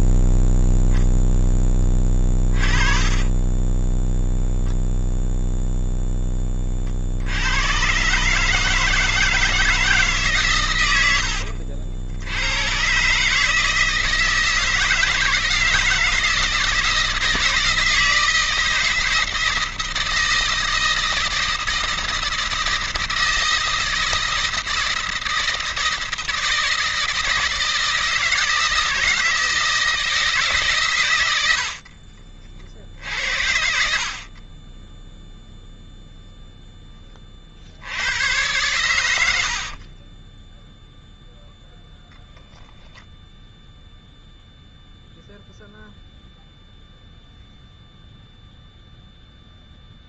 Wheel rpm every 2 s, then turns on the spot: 0, 30, 0, 20, 150, 120, 100, 160, 160, 160, 160, 160, 160, 160, 160, 150, 60, 40, 0, 90, 10, 0, 0, 0, 0.
2-4 38-42